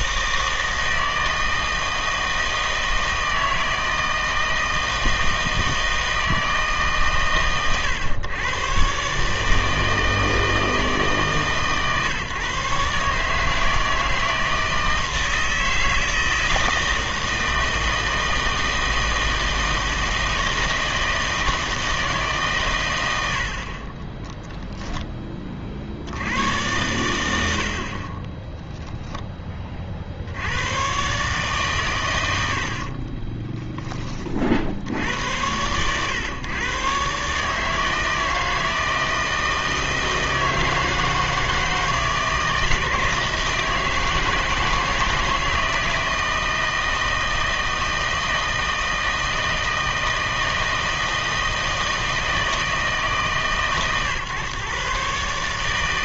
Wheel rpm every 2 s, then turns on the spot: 160, 160, 160, 150, 120, 160, 140, 160, 160, 160, 160, 110, 10, 100, 10, 120, 60, 70, 130, 160, 160, 160, 160, 160, 160, 160, 160, 130.
32-34